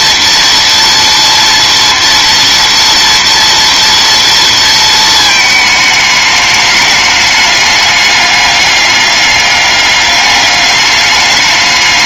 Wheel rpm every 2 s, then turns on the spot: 230, 230, 230, 210, 200, 200.
none